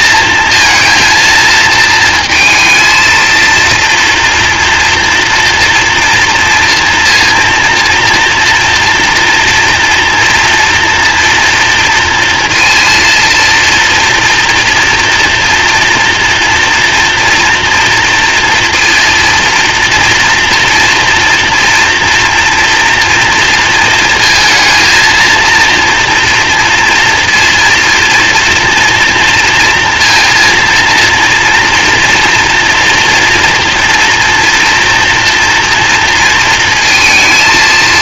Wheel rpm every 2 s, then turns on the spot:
230, 230, 230, 230, 230, 230, 230, 230, 240, 230, 230, 230, 230, 230, 230, 230, 230, 230, 230.
none